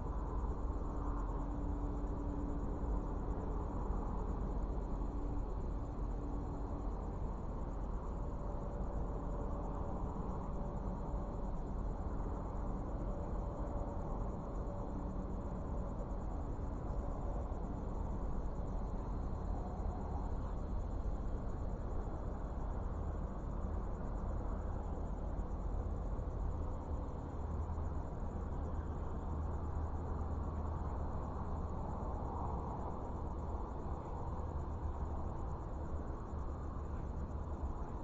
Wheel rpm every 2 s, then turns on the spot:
0, 0, 0, 0, 0, 0, 0, 0, 0, 0, 0, 0, 0, 0, 0, 0, 0, 0, 0.
none